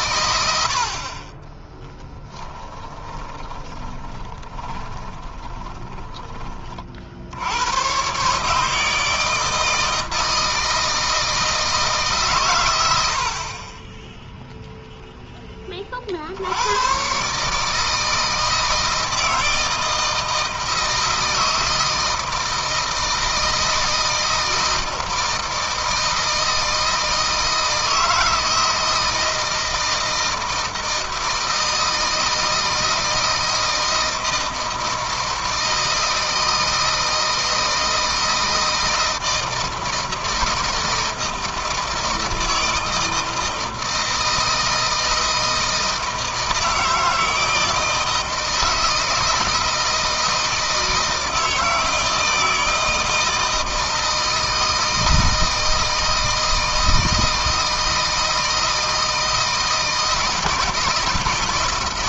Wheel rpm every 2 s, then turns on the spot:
60, 10, 20, 40, 150, 160, 90, 0, 110, 160, 160, 160, 160, 160, 160, 160, 160, 160, 160, 160, 160, 160, 160, 160, 160, 160, 160, 160, 160, 160, 160.
0-6